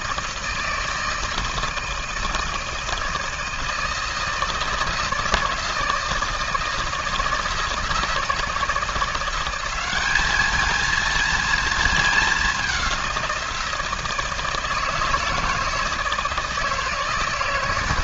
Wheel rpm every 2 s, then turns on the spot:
160, 160, 160, 160, 170, 220, 190, 160, 160.
none